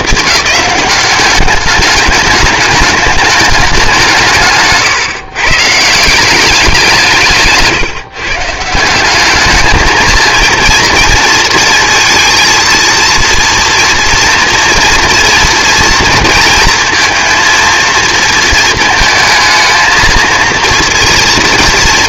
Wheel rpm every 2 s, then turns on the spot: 210, 200, 150, 190, 160, 230, 230, 230, 230, 230, 230.
none